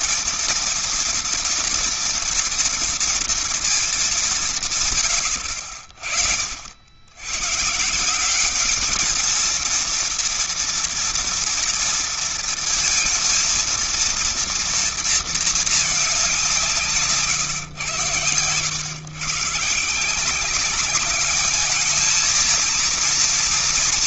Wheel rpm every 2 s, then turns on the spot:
230, 230, 180, 60, 190, 230, 230, 230, 190, 110, 180, 230.
none